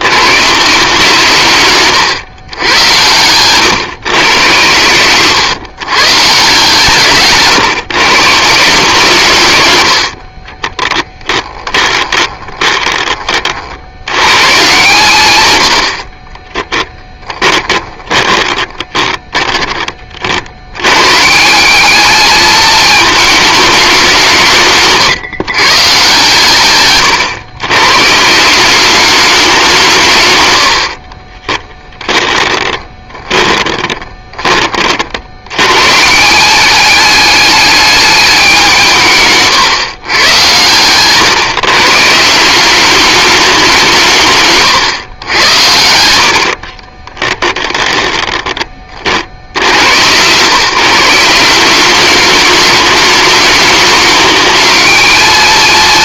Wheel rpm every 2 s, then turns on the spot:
160, 110, 110, 150, 160, 10, 20, 130, 10, 20, 100, 220, 140, 130, 200, 60, 20, 40, 210, 170, 130, 200, 130, 40, 10, 150, 210, 220.
10-14 16-20 26-28 30-34 40-42 46-48